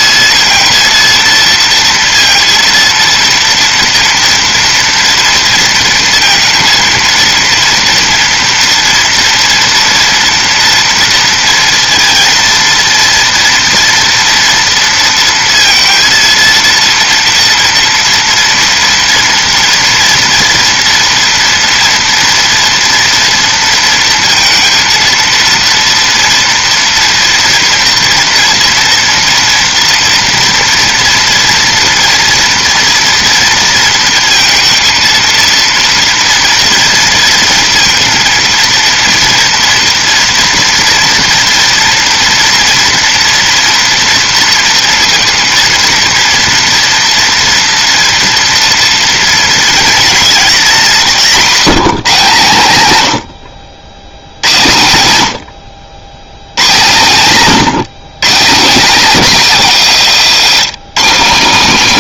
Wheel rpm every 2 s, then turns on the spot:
230, 230, 230, 230, 230, 230, 230, 230, 230, 230, 230, 230, 230, 230, 240, 230, 230, 230, 230, 230, 230, 230, 230, 230, 240, 210, 130, 90, 120, 230, 210.
none